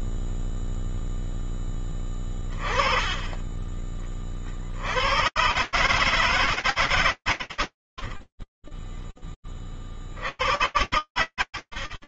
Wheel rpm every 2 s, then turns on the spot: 0, 10, 30, 130, 10, 90.
8-10